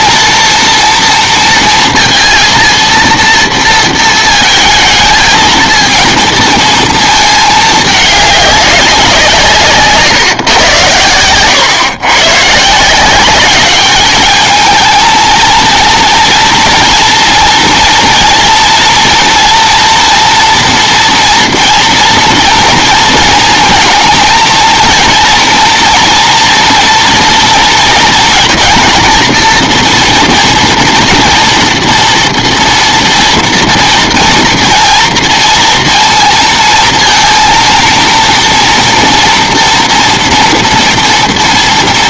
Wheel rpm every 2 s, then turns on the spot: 230, 230, 220, 230, 200, 110, 140, 210, 230, 230, 230, 230, 230, 230, 230, 230, 230, 230, 230, 230, 230.
none